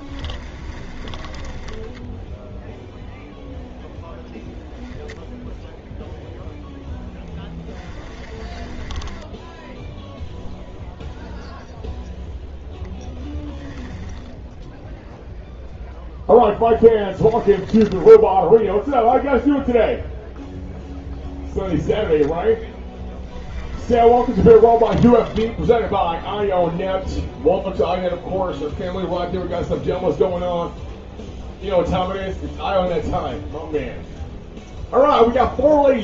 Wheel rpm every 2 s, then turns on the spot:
20, 0, 0, 0, 20, 0, 10, 0, 10, 0, 0, 0, 30, 0, 0, 0, 0, 0.
0-2 8-10 12-14 16-18 24-26